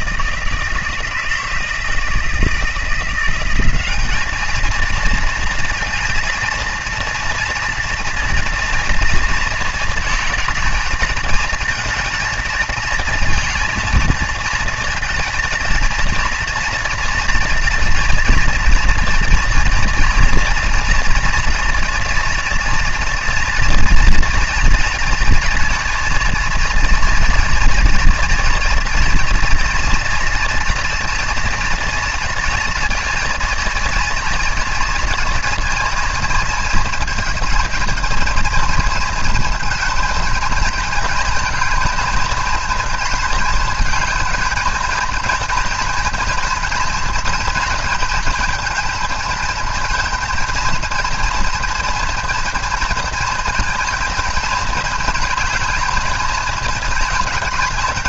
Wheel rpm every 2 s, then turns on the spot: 160, 160, 220, 230, 230, 220, 220, 220, 230, 230, 230, 230, 230, 230, 240, 240, 230, 230, 230, 230, 220, 230, 220, 240, 230, 230, 240, 230, 220.
none